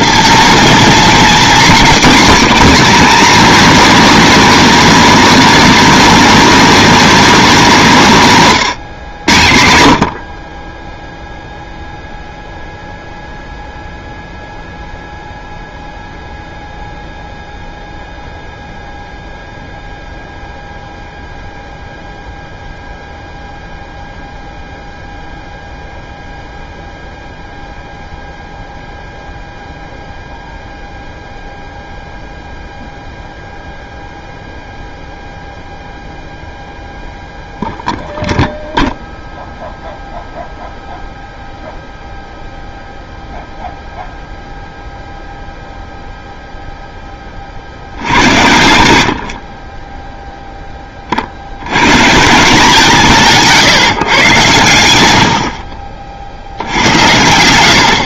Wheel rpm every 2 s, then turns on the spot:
230, 280, 280, 280, 170, 30, 0, 0, 0, 0, 0, 0, 0, 0, 0, 0, 0, 0, 0, 0, 0, 0, 0, 0, 80, 10, 170, 110, 70.
none